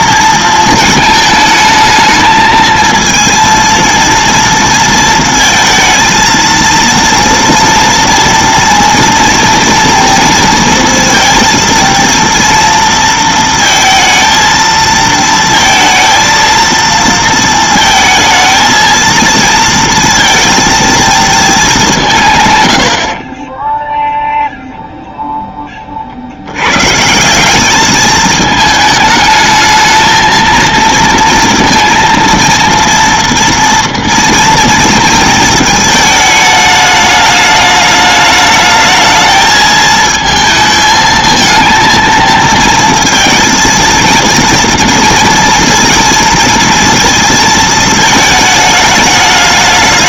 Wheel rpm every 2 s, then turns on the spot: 230, 220, 230, 230, 230, 230, 230, 230, 230, 220, 230, 80, 0, 130, 220, 230, 230, 230, 210, 220, 220, 220, 230, 230, 220.
none